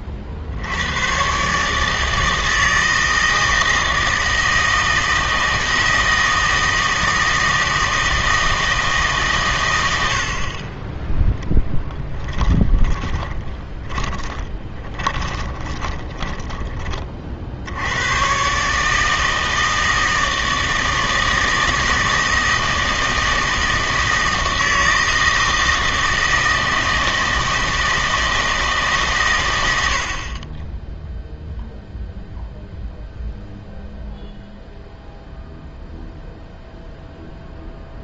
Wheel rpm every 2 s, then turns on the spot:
90, 160, 160, 160, 160, 30, 10, 20, 20, 140, 160, 160, 160, 160, 150, 10, 0, 0, 0.
12-18